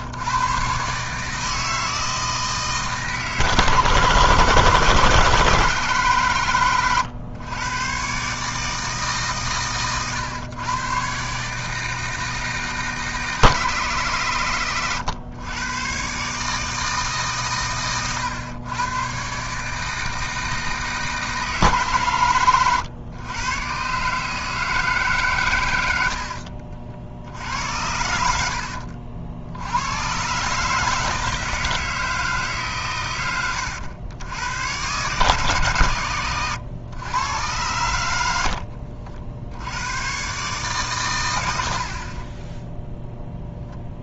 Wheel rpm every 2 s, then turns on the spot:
130, 160, 160, 120, 150, 120, 160, 130, 150, 110, 160, 110, 160, 60, 60, 150, 130, 120, 110, 70, 130, 10.
28-30 38-40